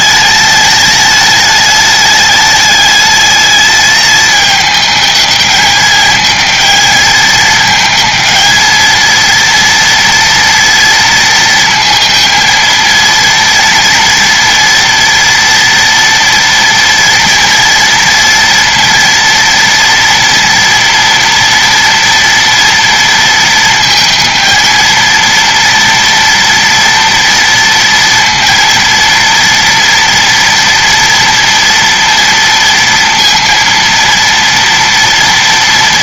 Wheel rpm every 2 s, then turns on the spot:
210, 210, 210, 220, 220, 230, 220, 240, 230, 230, 230, 230, 230, 230, 230, 230, 230, 230.
none